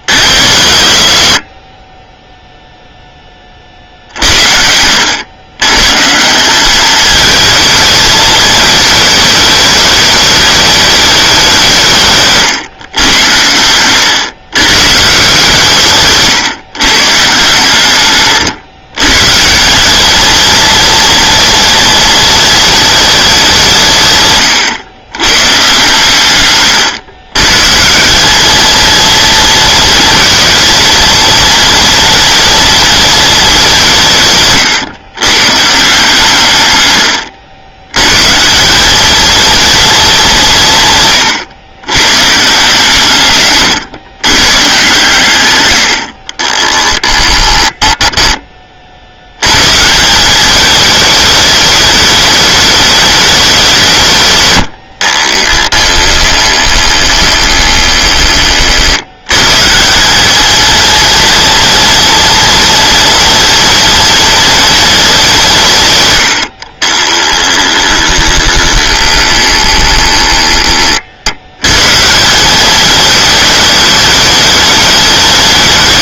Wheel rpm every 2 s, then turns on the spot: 40, 0, 80, 210, 210, 210, 120, 140, 140, 130, 230, 220, 100, 120, 230, 230, 230, 120, 120, 200, 140, 150, 130, 10, 50, 210, 210, 70, 20, 60, 230, 230, 220, 40, 20, 30, 210, 200.
36-38 46-48 54-58 66-70